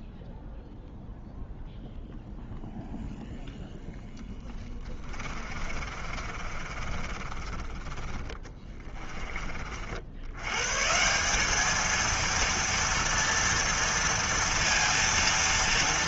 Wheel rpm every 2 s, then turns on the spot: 0, 0, 10, 40, 40, 80, 230, 230.
6-10